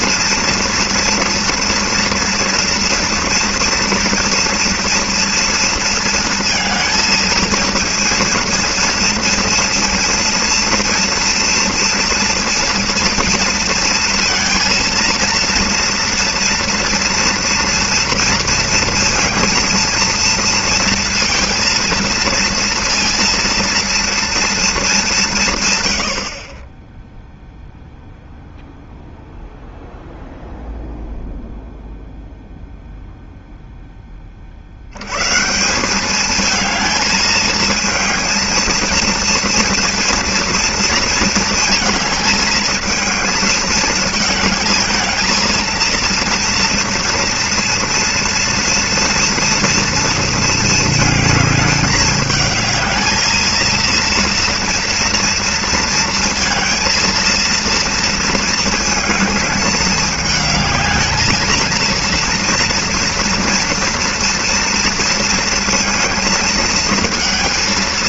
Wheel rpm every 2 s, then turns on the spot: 230, 230, 230, 220, 230, 230, 230, 230, 240, 230, 230, 230, 230, 50, 0, 0, 0, 50, 220, 230, 230, 220, 220, 230, 230, 230, 220, 230, 230, 220, 210, 230, 230, 220.
none